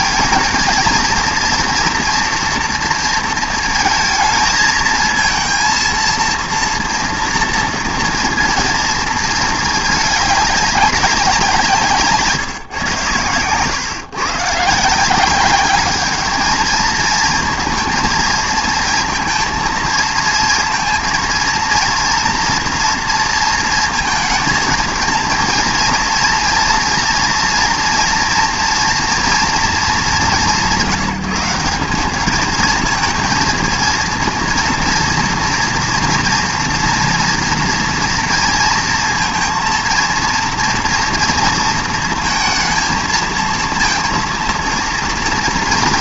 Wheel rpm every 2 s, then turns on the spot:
230, 230, 220, 230, 230, 200, 130, 160, 220, 230, 230, 230, 220, 230, 230, 150, 230, 230, 230, 230, 230, 230, 230.
none